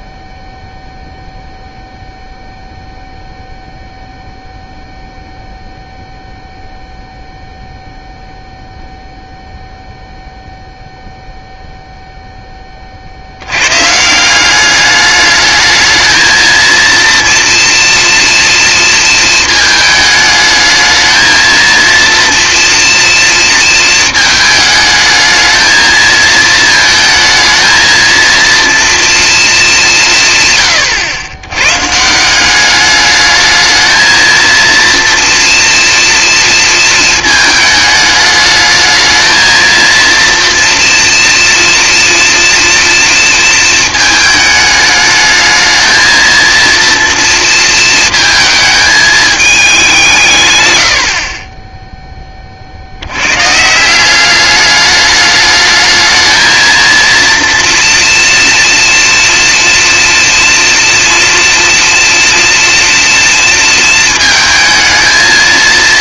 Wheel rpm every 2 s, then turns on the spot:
0, 0, 0, 0, 0, 0, 50, 210, 230, 230, 220, 230, 220, 220, 230, 100, 210, 230, 220, 220, 230, 230, 210, 230, 220, 80, 80, 210, 230, 230, 240, 230, 220.
none